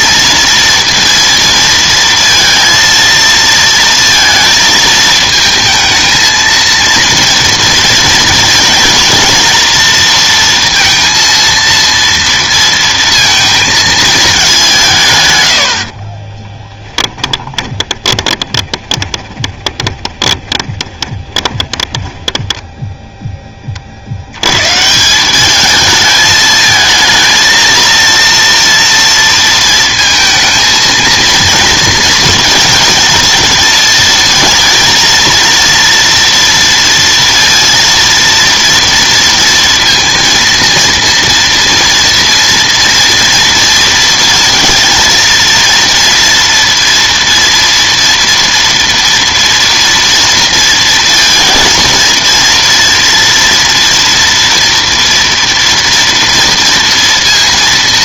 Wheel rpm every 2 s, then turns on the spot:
230, 230, 220, 230, 220, 230, 230, 190, 10, 20, 30, 10, 130, 220, 230, 230, 230, 230, 230, 230, 230, 230, 230, 230, 230, 230, 230, 240, 230.
16-22